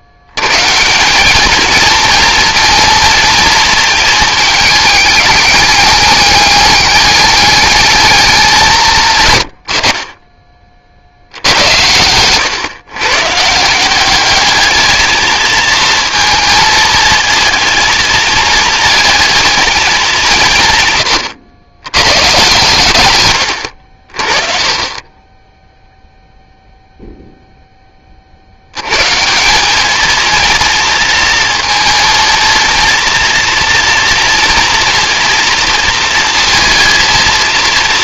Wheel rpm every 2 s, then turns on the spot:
110, 230, 220, 210, 180, 30, 120, 210, 230, 220, 160, 130, 40, 0, 50, 230, 230, 230, 230.
none